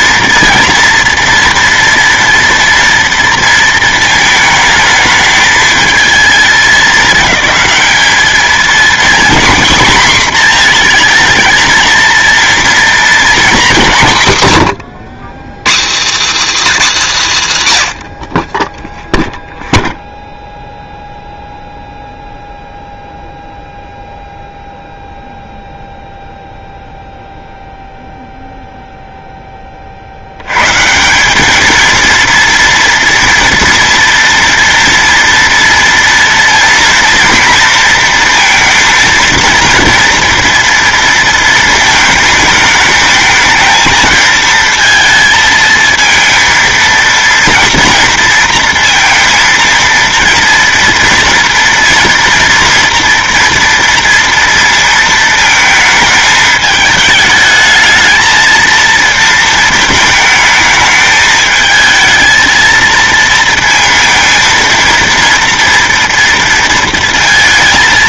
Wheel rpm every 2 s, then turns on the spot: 230, 230, 220, 220, 220, 240, 230, 150, 270, 40, 0, 0, 0, 0, 0, 100, 230, 230, 230, 230, 230, 220, 220, 230, 230, 230, 230, 230, 220, 220, 220, 220, 230, 230.
none